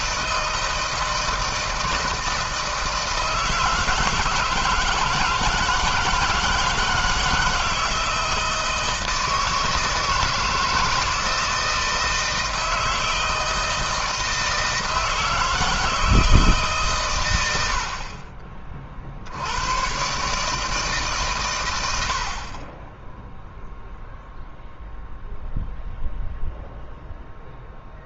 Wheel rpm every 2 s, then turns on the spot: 160, 160, 160, 160, 160, 160, 160, 160, 140, 40, 140, 40, 0, 0.
none